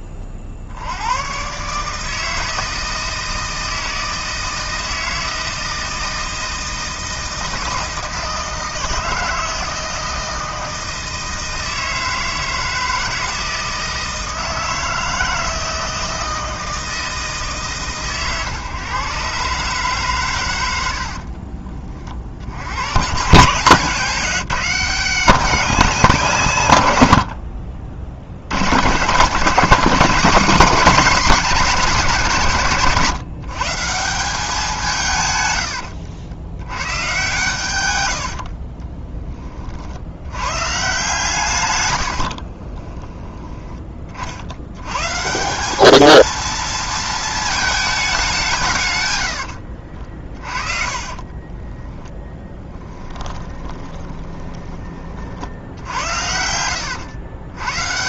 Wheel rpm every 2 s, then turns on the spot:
70, 160, 160, 160, 160, 160, 160, 160, 160, 130, 80, 110, 190, 100, 120, 250, 160, 160, 110, 30, 150, 30, 120, 230, 120, 30, 10, 30, 100.
20-22 42-44 50-54